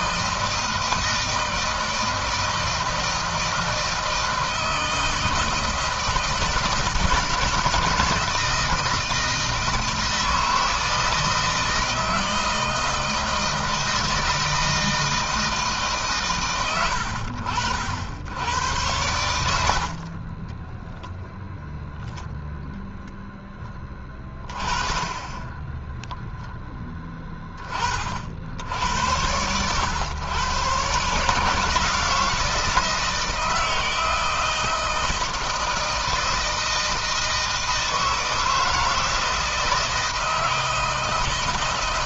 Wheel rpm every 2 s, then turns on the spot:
160, 160, 160, 160, 160, 160, 160, 160, 120, 100, 20, 0, 20, 10, 70, 130, 160, 160, 160, 160, 160.
20-22